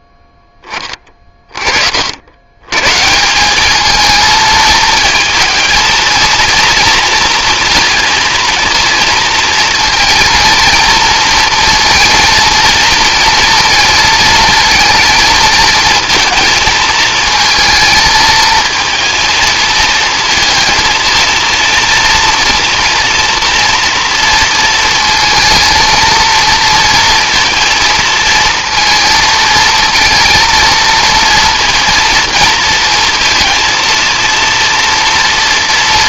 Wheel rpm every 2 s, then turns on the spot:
10, 130, 220, 230, 230, 230, 230, 230, 220, 230, 230, 230, 230, 230, 230, 230, 230, 240.
none